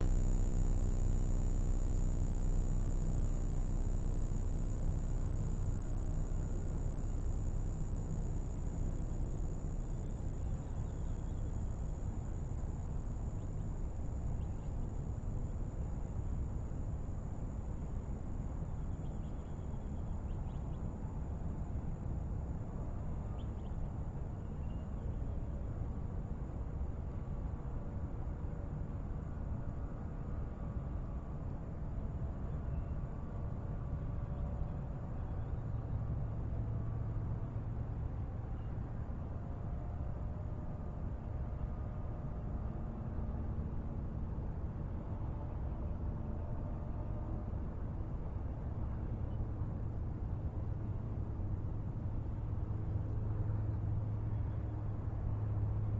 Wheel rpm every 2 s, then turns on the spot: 0, 0, 0, 0, 0, 0, 0, 0, 0, 0, 0, 0, 0, 0, 0, 0, 0, 0, 0, 0, 0, 0, 0, 0, 0, 0, 0, 0.
none